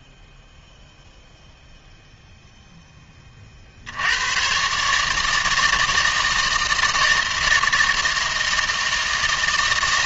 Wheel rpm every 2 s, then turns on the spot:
0, 0, 140, 160, 160.
none